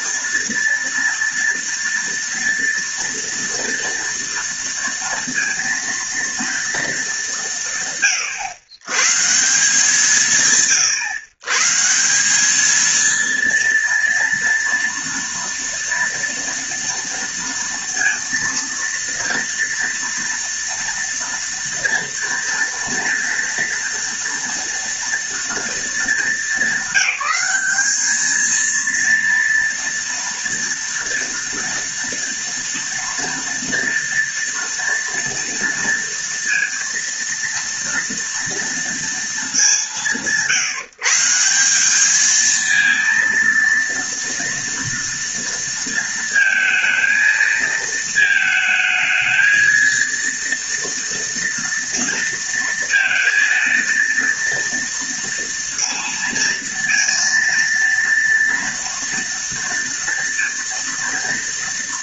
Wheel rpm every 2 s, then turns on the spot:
230, 230, 230, 220, 130, 140, 220, 230, 230, 230, 240, 230, 230, 190, 230, 230, 230, 230, 230, 230, 150, 220, 230, 230, 220, 230, 230, 230, 230, 230, 230.
none